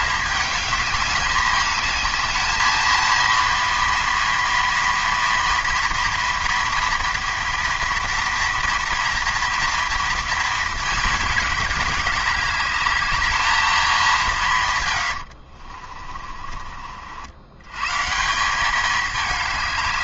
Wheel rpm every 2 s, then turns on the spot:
210, 230, 240, 230, 240, 210, 210, 90, 80, 210.
14-16